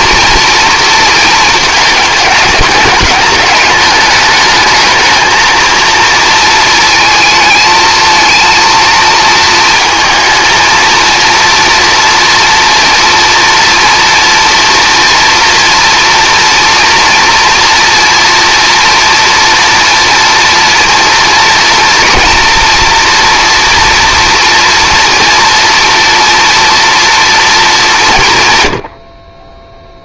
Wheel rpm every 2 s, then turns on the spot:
230, 210, 220, 230, 230, 230, 230, 230, 240, 230, 230, 230, 240, 240, 130.
none